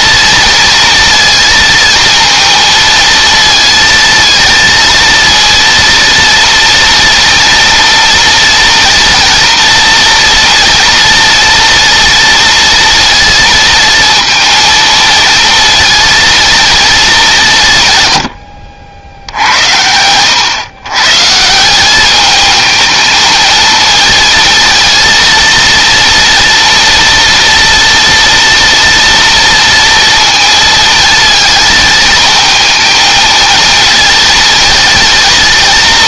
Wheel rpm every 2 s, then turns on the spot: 230, 230, 230, 230, 240, 240, 230, 230, 220, 80, 110, 220, 230, 230, 230, 230, 220, 230.
18-20